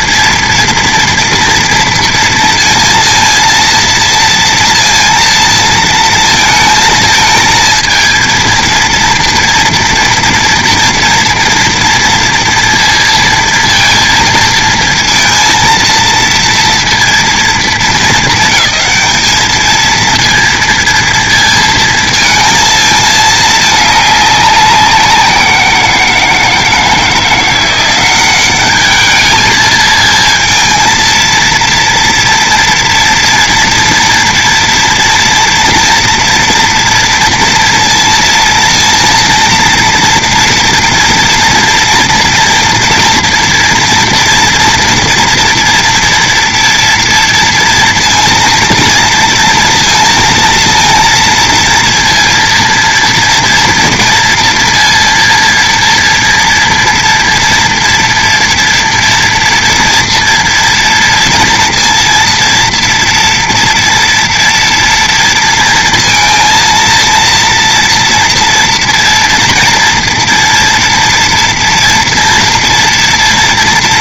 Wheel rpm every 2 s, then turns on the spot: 230, 230, 230, 220, 230, 240, 230, 230, 230, 220, 230, 220, 190, 160, 200, 230, 240, 240, 230, 230, 230, 230, 230, 230, 230, 230, 230, 230, 230, 230, 230, 230, 240, 230, 230, 240, 230.
none